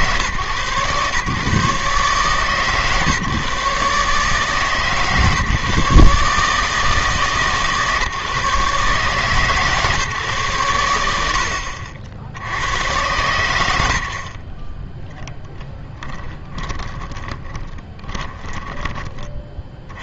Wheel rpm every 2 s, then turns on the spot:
130, 140, 150, 150, 150, 110, 100, 20, 20, 20.
16-20